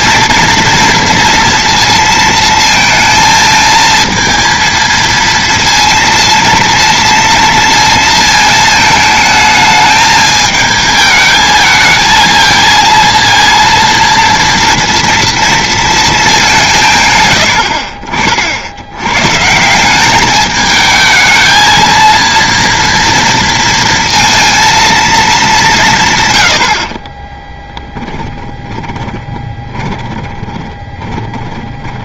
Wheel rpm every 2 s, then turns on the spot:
240, 230, 230, 230, 220, 220, 230, 230, 150, 70, 210, 230, 230, 70, 20, 20.
28-32